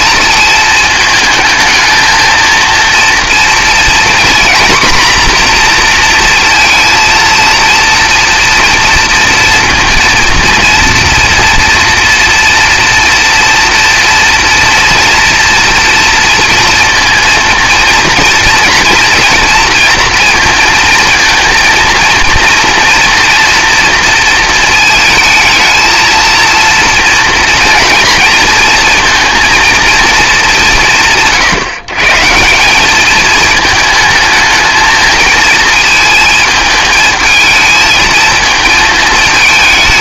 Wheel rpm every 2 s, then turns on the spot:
220, 230, 240, 230, 240, 230, 230, 230, 230, 230, 230, 230, 220, 230, 230, 190, 190, 220, 220, 220.
none